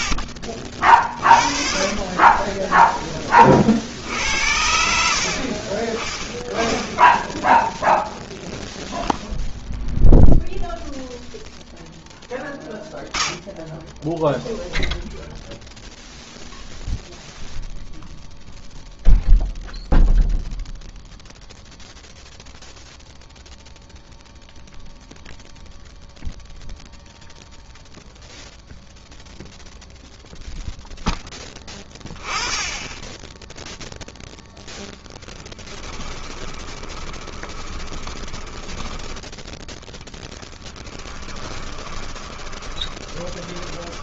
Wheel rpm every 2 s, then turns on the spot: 40, 10, 60, 10, 0, 0, 0, 0, 0, 0, 0, 0, 0, 0, 0, 0, 10, 0, 20, 10, 10, 20.
36-44